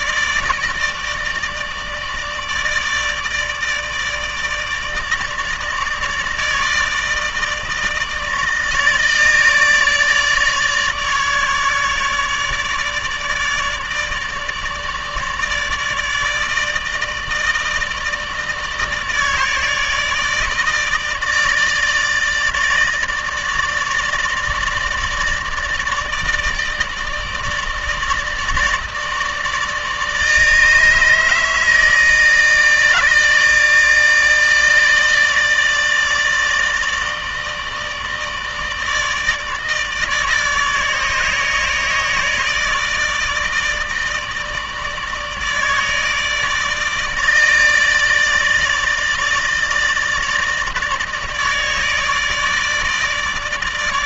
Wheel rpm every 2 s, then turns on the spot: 160, 150, 160, 160, 150, 150, 150, 150, 160, 160, 160, 160, 150, 160, 160, 160, 160, 160, 160, 150, 150, 160, 150, 160, 150, 150, 150.
none